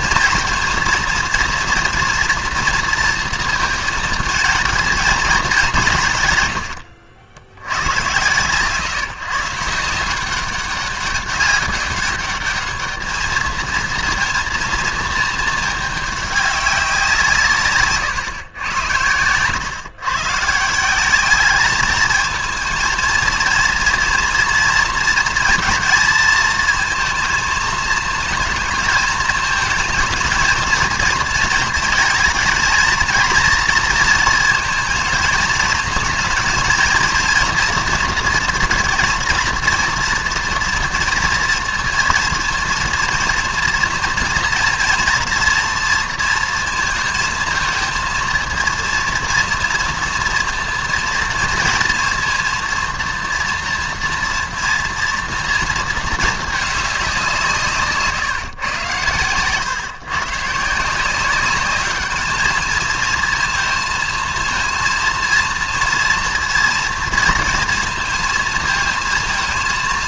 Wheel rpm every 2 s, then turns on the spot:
230, 240, 220, 140, 120, 180, 200, 230, 210, 130, 130, 220, 230, 230, 220, 220, 230, 230, 220, 230, 230, 230, 240, 230, 220, 230, 230, 230, 230, 150, 130, 210, 230, 230, 230.
58-60